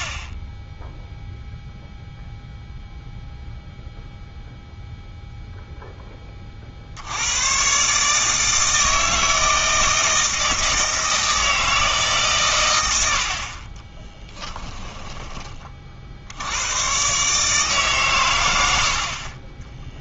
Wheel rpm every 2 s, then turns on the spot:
10, 0, 0, 50, 160, 160, 100, 20, 100, 80.
14-16